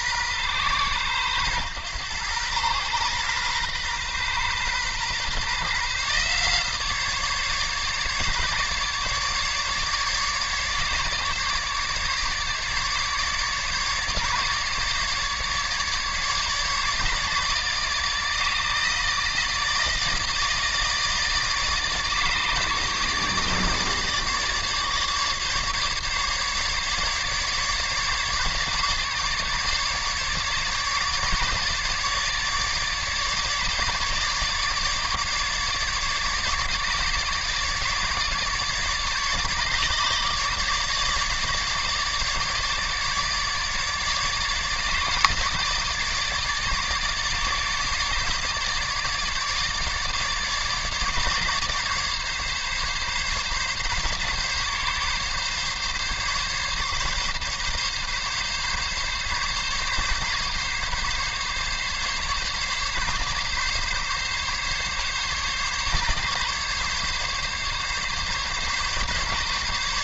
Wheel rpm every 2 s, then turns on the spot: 120, 120, 130, 150, 150, 150, 150, 150, 150, 160, 160, 150, 150, 150, 150, 150, 150, 150, 150, 150, 150, 150, 150, 150, 150, 150, 140, 140, 140, 140, 140, 140, 140, 140, 140.
none